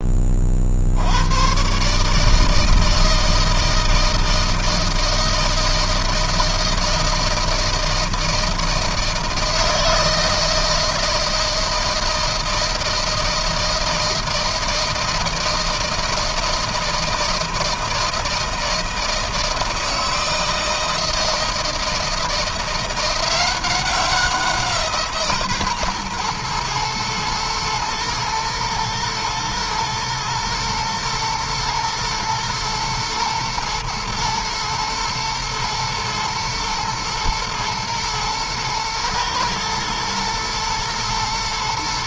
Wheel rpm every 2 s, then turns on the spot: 40, 160, 160, 160, 160, 160, 160, 160, 160, 160, 160, 170, 180, 120, 120, 110, 120, 110, 110, 120, 110.
none